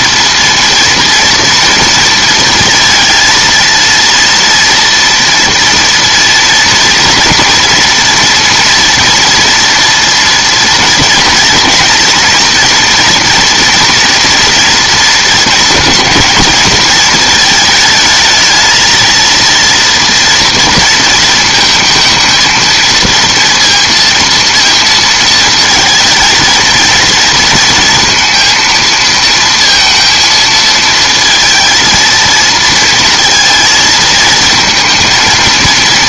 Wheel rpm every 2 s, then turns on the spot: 230, 230, 230, 240, 240, 240, 230, 230, 220, 220, 230, 220, 230, 230, 230, 230, 230, 220.
none